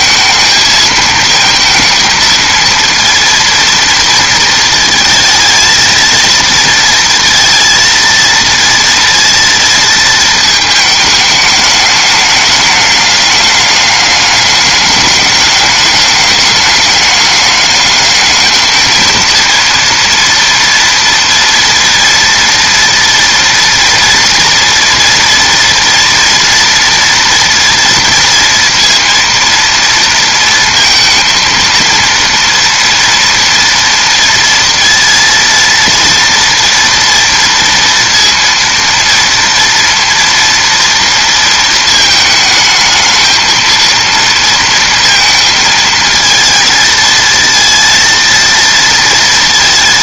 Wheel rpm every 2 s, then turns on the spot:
220, 230, 220, 230, 230, 220, 210, 210, 210, 220, 230, 230, 230, 230, 230, 230, 230, 230, 240, 230, 230, 220, 230, 220, 230.
none